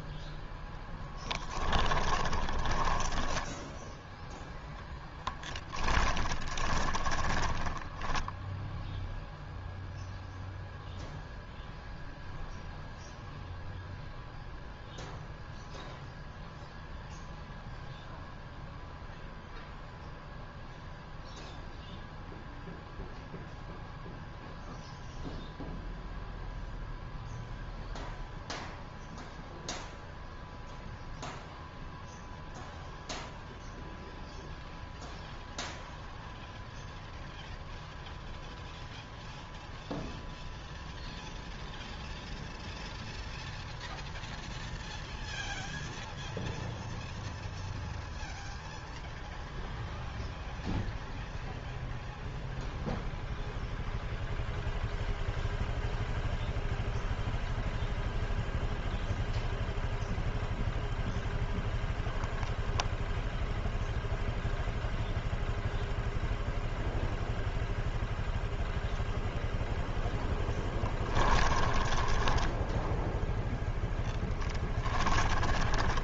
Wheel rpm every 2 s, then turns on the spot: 0, 20, 10, 10, 0, 0, 0, 0, 0, 0, 0, 0, 0, 0, 0, 0, 0, 0, 0, 0, 0, 0, 0, 0, 0, 0, 0, 0, 0, 0, 0, 0, 0, 0, 0, 10, 10, 10.
2-4 6-8 70-76